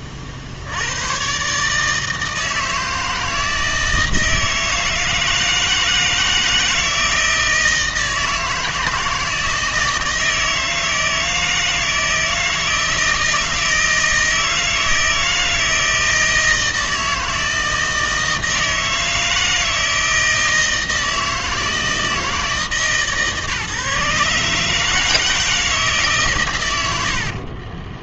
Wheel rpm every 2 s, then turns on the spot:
70, 160, 160, 160, 160, 160, 160, 160, 160, 160, 160, 160, 150, 100.
none